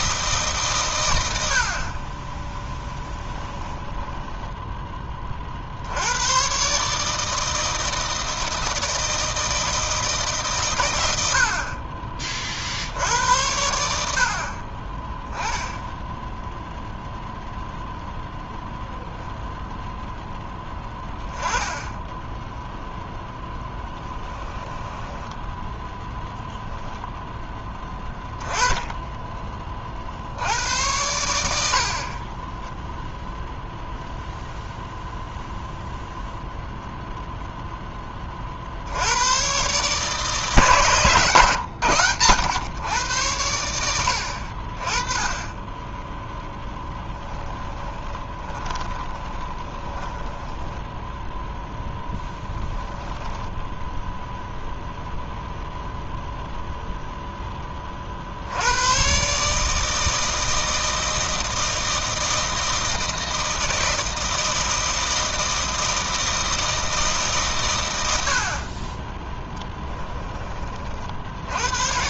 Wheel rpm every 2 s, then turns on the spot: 120, 10, 10, 140, 160, 100, 70, 30, 0, 0, 10, 0, 10, 0, 20, 90, 0, 0, 0, 70, 150, 110, 30, 10, 20, 10, 10, 0, 0, 110, 160, 160, 160, 160, 30, 50.
2-4 24-26 46-54